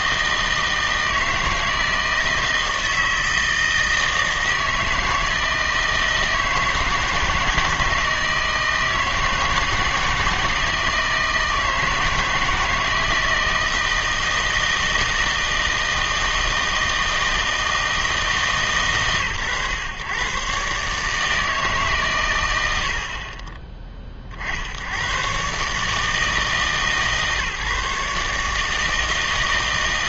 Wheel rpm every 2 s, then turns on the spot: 160, 160, 160, 160, 160, 160, 160, 160, 160, 140, 140, 90, 80, 150, 160.
none